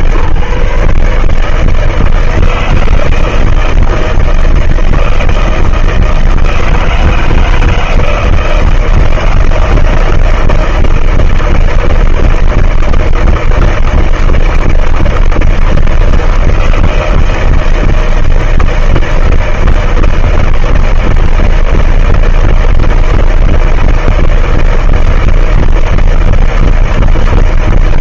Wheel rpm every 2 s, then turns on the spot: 140, 160, 160, 160, 160, 160, 160, 160, 160, 160, 160, 160, 160, 160.
none